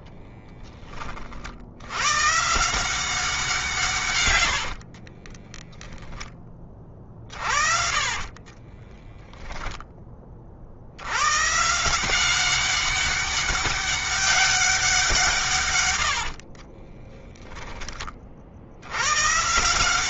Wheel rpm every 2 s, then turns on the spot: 30, 170, 70, 30, 20, 60, 200, 190, 30, 80.
4-10 16-18